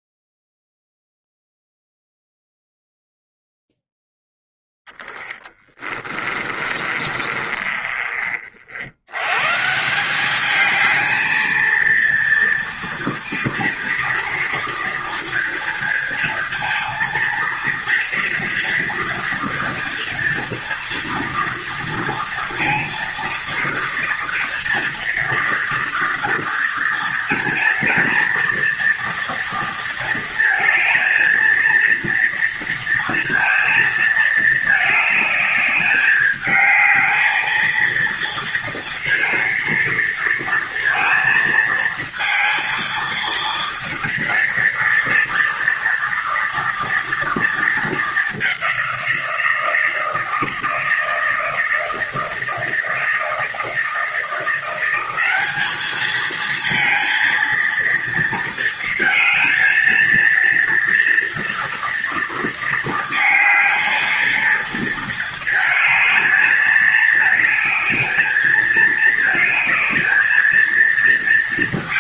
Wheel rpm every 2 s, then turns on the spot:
0, 0, 10, 20, 70, 210, 230, 230, 230, 230, 230, 230, 240, 230, 230, 220, 230, 210, 210, 230, 230, 230, 230, 230, 190, 160, 160, 180, 220, 230, 230, 230, 220, 210, 220, 220.
6-8